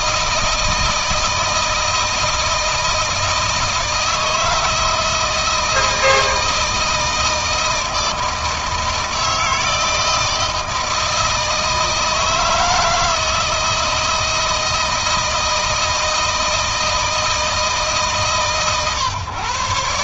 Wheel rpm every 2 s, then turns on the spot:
160, 160, 160, 160, 160, 160, 160, 160, 160, 140.
none